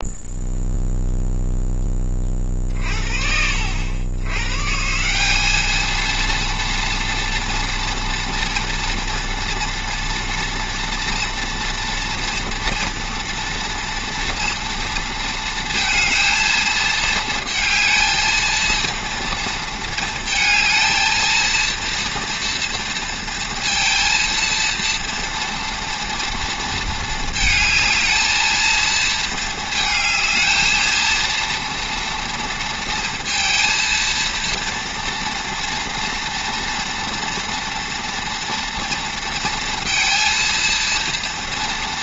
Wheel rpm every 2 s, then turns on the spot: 0, 60, 170, 230, 230, 230, 230, 230, 230, 230, 230, 230, 230, 220, 220, 220, 230, 230, 230, 230, 230.
none